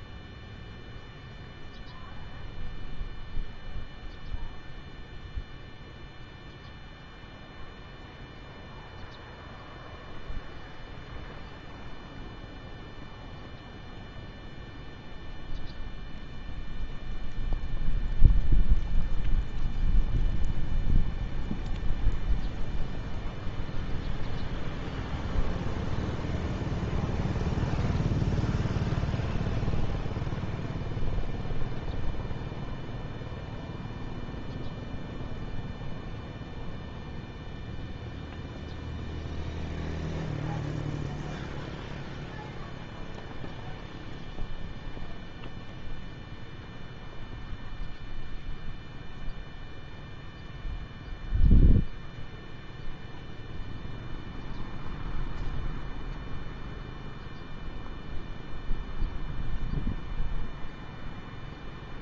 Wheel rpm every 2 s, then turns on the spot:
0, 0, 0, 0, 0, 0, 0, 0, 0, 0, 0, 0, 0, 0, 0, 0, 0, 0, 0, 0, 0, 0, 0, 0, 0, 0, 0, 0, 0, 0, 0.
none